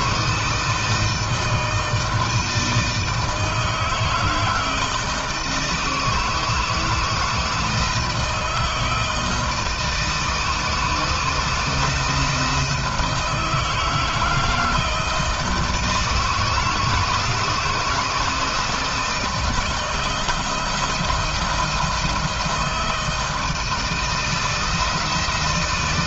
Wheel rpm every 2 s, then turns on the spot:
160, 160, 160, 160, 160, 160, 160, 160, 160, 160, 170, 160, 160.
none